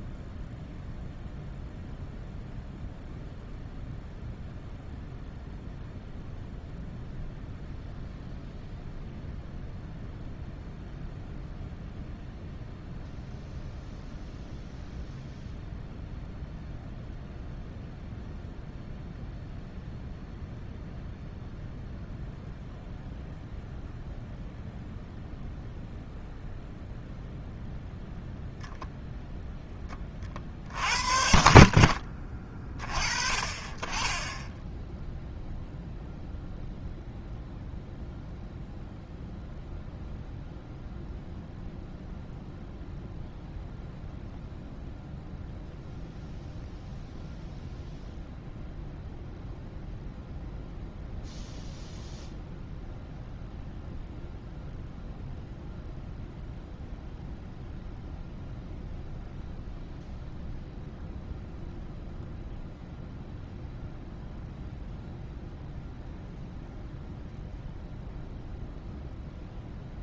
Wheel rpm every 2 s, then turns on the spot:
0, 0, 0, 0, 0, 0, 0, 0, 0, 0, 0, 0, 0, 0, 0, 60, 30, 0, 0, 0, 0, 0, 0, 0, 0, 0, 0, 0, 0, 0, 0, 0, 0, 0, 0.
none